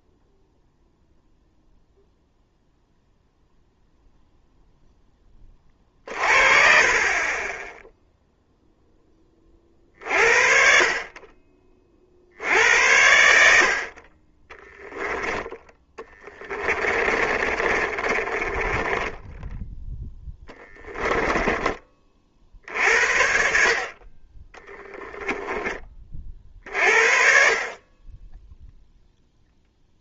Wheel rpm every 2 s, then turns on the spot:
0, 0, 0, 40, 0, 50, 70, 10, 20, 20, 10, 60, 10, 50, 0.
14-22 24-26